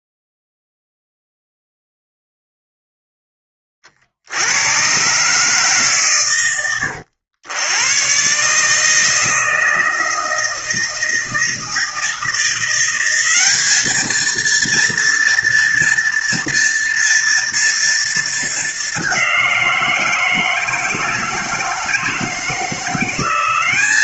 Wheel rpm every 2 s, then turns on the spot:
0, 0, 120, 100, 150, 160, 180, 230, 230, 200, 160, 170.
none